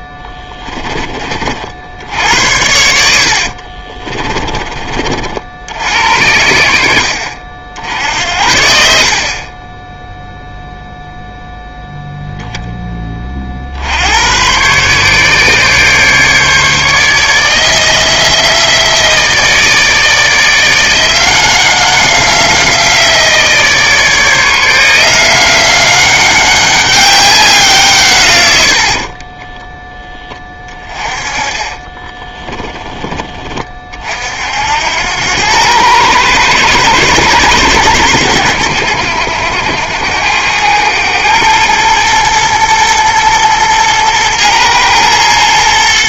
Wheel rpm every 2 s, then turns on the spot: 20, 70, 30, 60, 60, 0, 10, 130, 150, 160, 170, 170, 170, 200, 60, 20, 10, 70, 110, 90, 100, 110, 110.
28-30